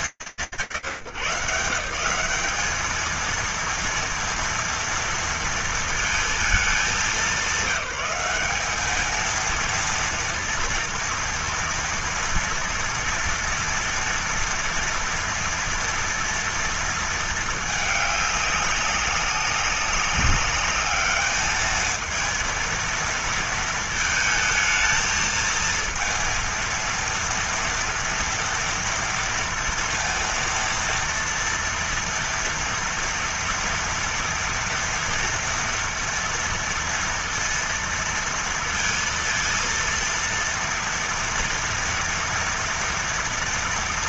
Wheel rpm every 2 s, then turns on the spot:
120, 200, 230, 210, 200, 230, 230, 230, 220, 200, 210, 230, 230, 230, 230, 230, 230, 230, 230, 230, 230, 230.
none